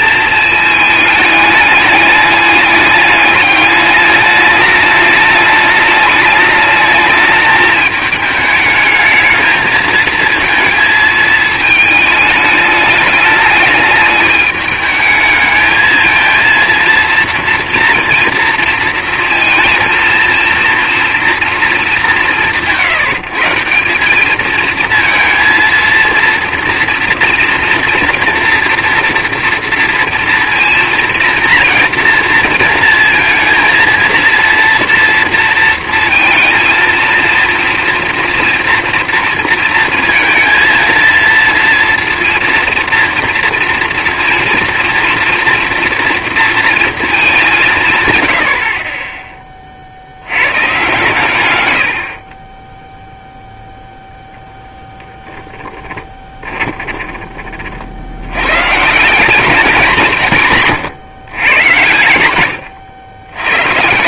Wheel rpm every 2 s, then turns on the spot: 210, 210, 210, 220, 220, 220, 210, 220, 240, 230, 230, 130, 220, 240, 230, 230, 230, 230, 230, 230, 230, 230, 230, 220, 30, 130, 0, 0, 20, 170, 140, 100.
56-58